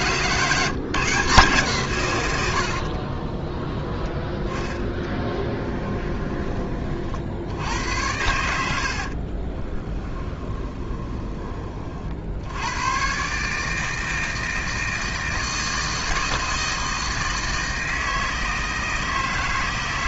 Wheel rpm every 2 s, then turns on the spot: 170, 80, 10, 30, 70, 10, 100, 160, 160, 160.
2-4 10-12